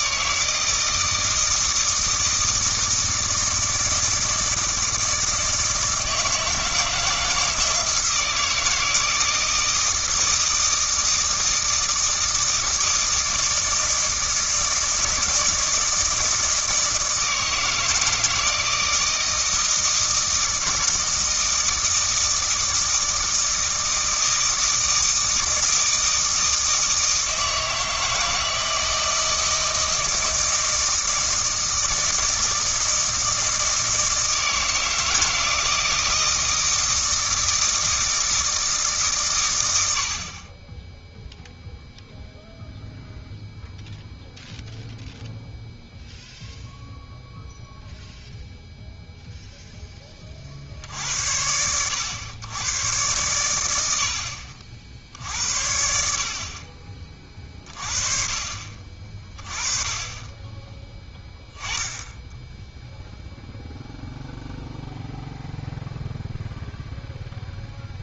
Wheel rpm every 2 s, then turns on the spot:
160, 160, 160, 160, 160, 160, 160, 160, 160, 160, 160, 160, 160, 160, 160, 160, 160, 160, 160, 160, 20, 0, 0, 0, 0, 60, 110, 60, 40, 40, 20, 10, 0, 0.
none